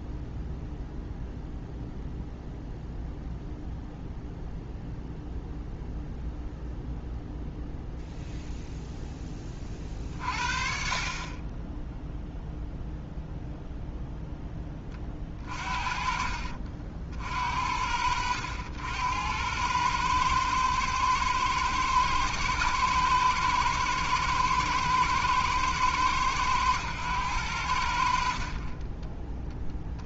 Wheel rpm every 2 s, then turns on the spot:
0, 0, 0, 0, 0, 30, 0, 20, 60, 80, 110, 110, 110, 100, 20.
28-30